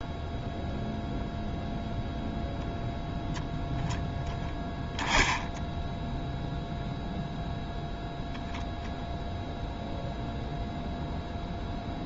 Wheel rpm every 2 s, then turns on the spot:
0, 0, 10, 0, 0, 0.
none